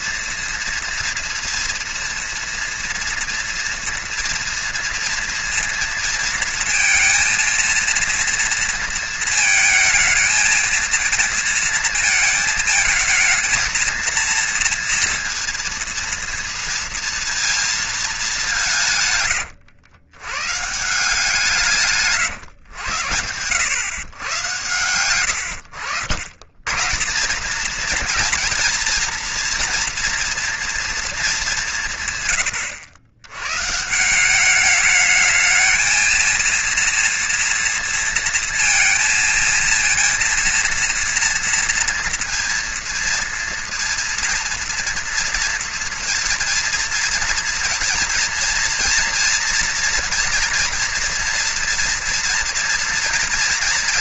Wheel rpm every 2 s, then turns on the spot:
230, 230, 230, 230, 230, 220, 220, 230, 230, 200, 120, 140, 130, 100, 230, 230, 130, 190, 220, 230, 230, 230, 230, 230, 230, 230, 230.
none